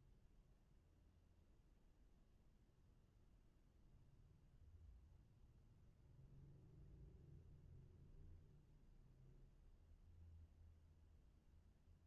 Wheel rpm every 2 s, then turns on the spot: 0, 0, 0, 0, 0, 0.
none